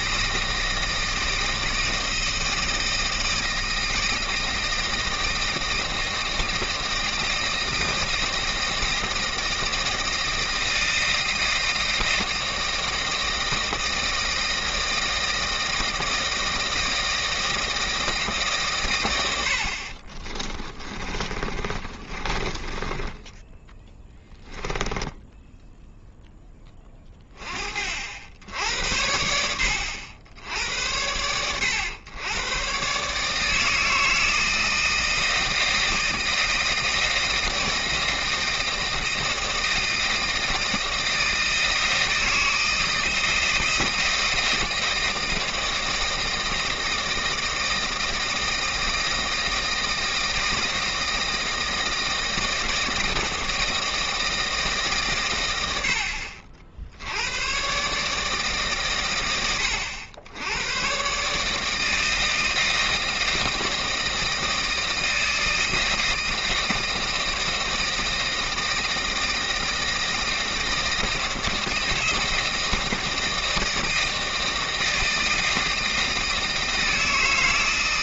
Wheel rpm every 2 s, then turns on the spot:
160, 160, 160, 160, 160, 160, 160, 160, 160, 130, 20, 30, 10, 20, 80, 90, 130, 160, 160, 160, 160, 160, 160, 160, 170, 160, 160, 150, 70, 140, 110, 160, 160, 160, 160, 160, 160, 160, 160.
20-26